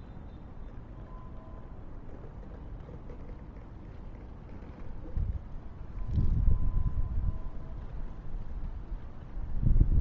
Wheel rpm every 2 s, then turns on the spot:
0, 0, 0, 0, 0.
none